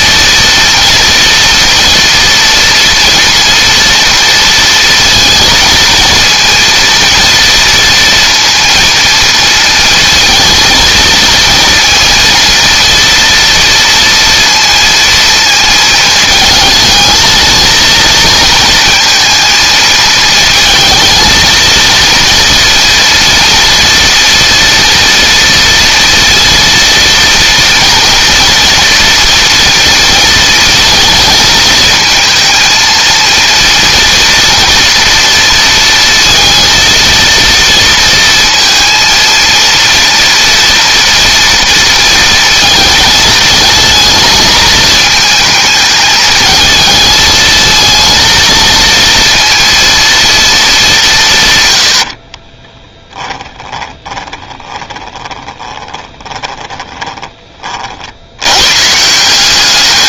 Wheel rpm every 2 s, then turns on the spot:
230, 230, 230, 230, 230, 230, 230, 230, 220, 230, 220, 230, 230, 230, 230, 230, 230, 240, 230, 230, 240, 220, 220, 220, 230, 200, 20, 20, 20, 120.
52-58